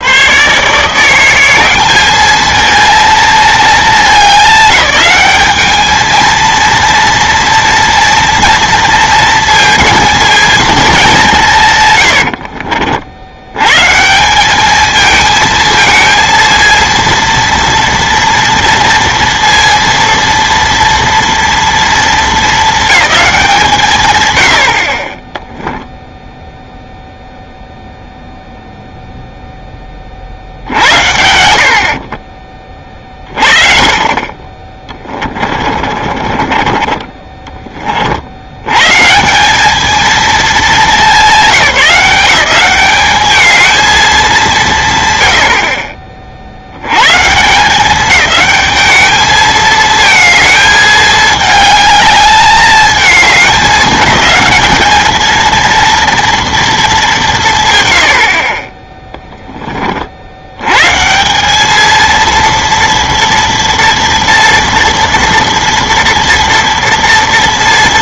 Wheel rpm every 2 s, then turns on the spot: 140, 220, 190, 230, 230, 220, 60, 200, 230, 230, 230, 210, 80, 0, 0, 60, 20, 30, 30, 110, 200, 180, 200, 80, 210, 220, 210, 210, 230, 40, 100, 230, 230, 230.
12-14 34-38